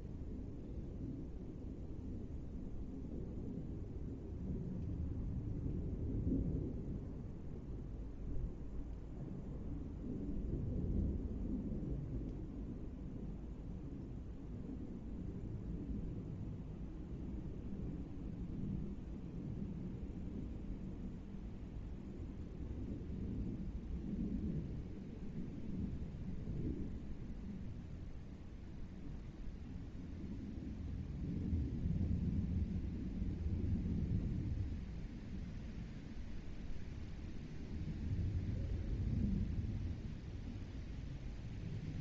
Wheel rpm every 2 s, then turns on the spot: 0, 0, 0, 0, 0, 0, 0, 0, 0, 0, 0, 0, 0, 0, 0, 0, 0, 0, 0, 0, 0.
none